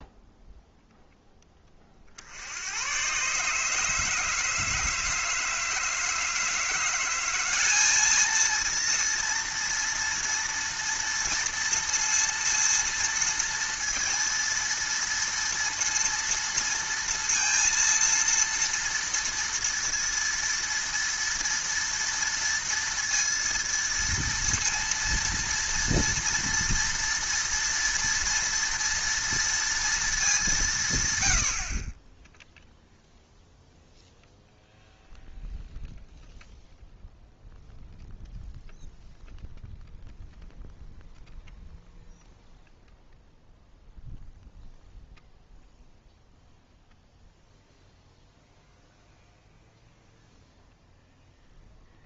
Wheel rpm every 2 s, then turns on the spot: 0, 90, 160, 160, 230, 230, 230, 230, 230, 230, 240, 230, 230, 230, 230, 170, 0, 0, 0, 0, 0, 0, 0, 0, 0, 0.
none